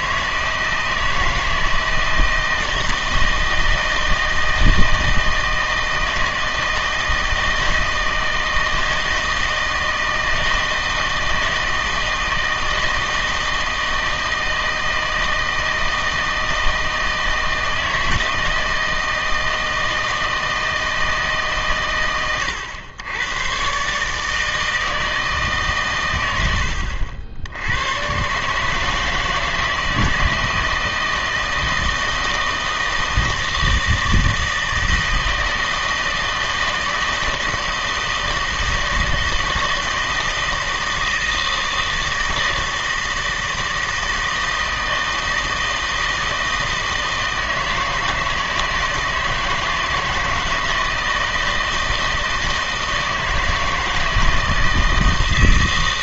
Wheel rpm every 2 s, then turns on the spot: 160, 160, 160, 160, 160, 160, 160, 160, 160, 160, 160, 100, 160, 80, 150, 160, 160, 160, 160, 160, 160, 160, 160, 160, 160, 160, 160, 160.
none